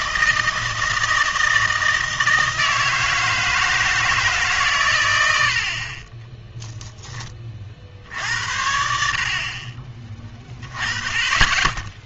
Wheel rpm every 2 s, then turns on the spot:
160, 160, 130, 0, 70, 20.
none